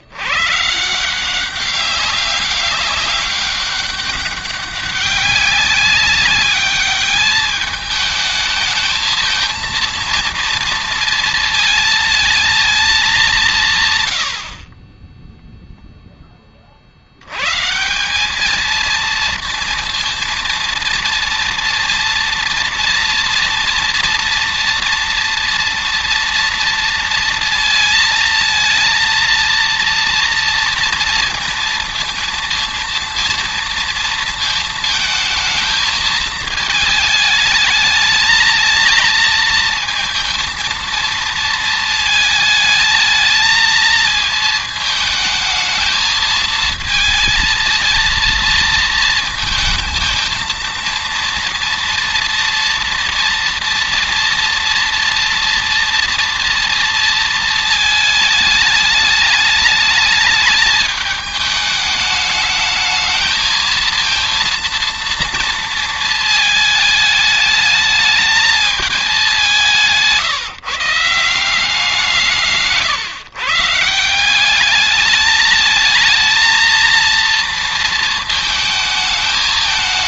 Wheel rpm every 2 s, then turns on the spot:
150, 200, 200, 210, 220, 230, 220, 50, 40, 220, 230, 230, 230, 230, 230, 230, 230, 220, 220, 220, 230, 220, 220, 230, 230, 230, 230, 230, 230, 210, 210, 210, 230, 220, 210, 150, 160, 200, 230, 220.
none